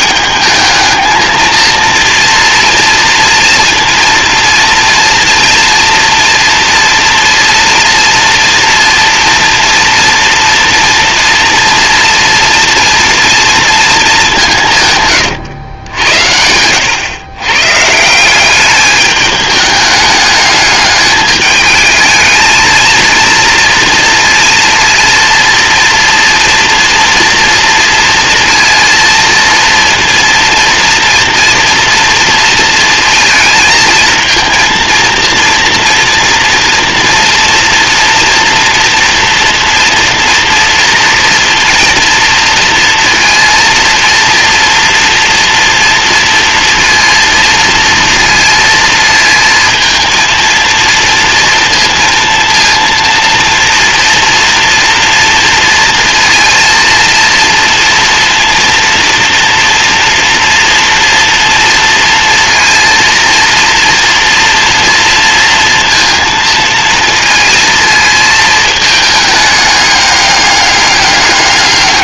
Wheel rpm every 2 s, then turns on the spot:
220, 230, 230, 230, 230, 240, 230, 140, 110, 210, 210, 230, 230, 230, 230, 230, 230, 230, 230, 230, 240, 230, 230, 230, 230, 230, 230, 230, 230, 230, 230, 230, 230, 220, 220, 200.
14-16